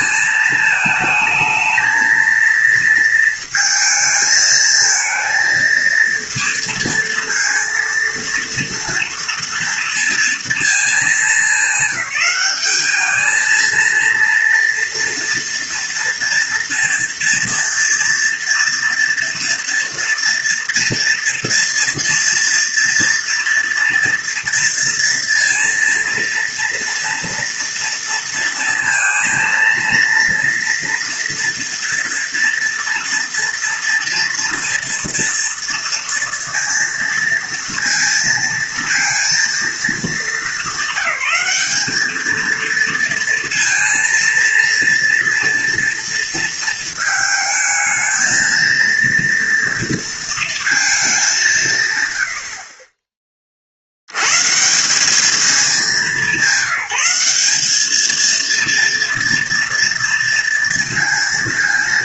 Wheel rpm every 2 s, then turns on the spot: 220, 230, 220, 230, 230, 230, 210, 230, 230, 230, 240, 240, 230, 230, 230, 230, 240, 230, 230, 230, 200, 230, 230, 220, 230, 220, 40, 180, 190, 230, 230.
none